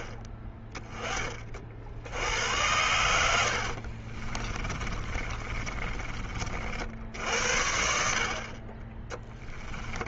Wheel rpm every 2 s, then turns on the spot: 10, 90, 30, 70, 20.
4-6